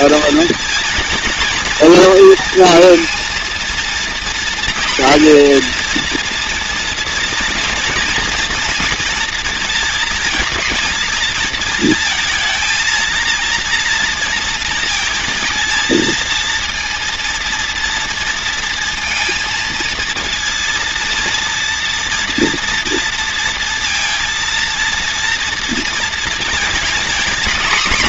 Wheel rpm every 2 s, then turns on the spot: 230, 230, 240, 230, 230, 220, 230, 230, 230, 230, 230, 230, 230, 240.
none